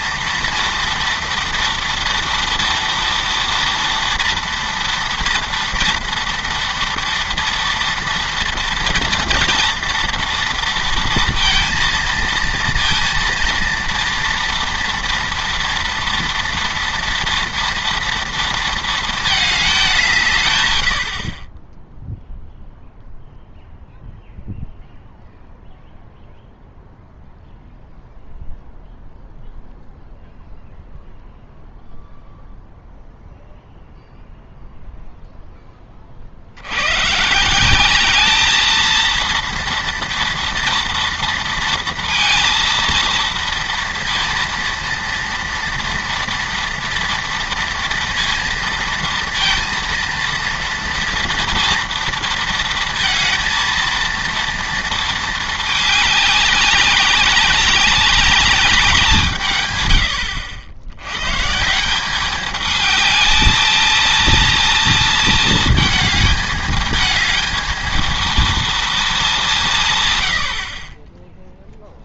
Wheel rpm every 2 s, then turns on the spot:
230, 230, 230, 230, 230, 230, 230, 230, 230, 230, 110, 0, 0, 0, 0, 0, 0, 0, 90, 220, 230, 230, 230, 230, 230, 230, 230, 230, 200, 200, 90, 210, 230, 220, 220, 40.
none